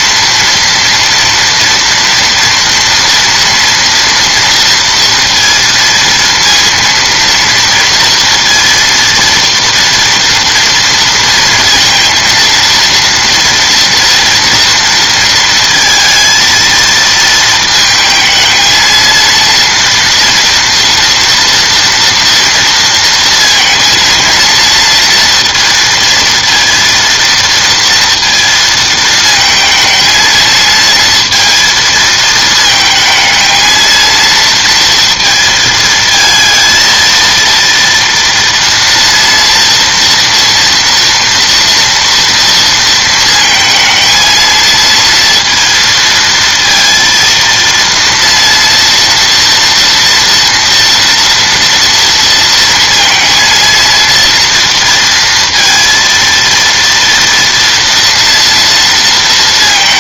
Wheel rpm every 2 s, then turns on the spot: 230, 230, 230, 230, 230, 230, 230, 230, 230, 220, 230, 230, 230, 230, 230, 220, 220, 230, 230, 240, 230, 230, 230, 230, 230, 240, 230, 230, 230, 230.
none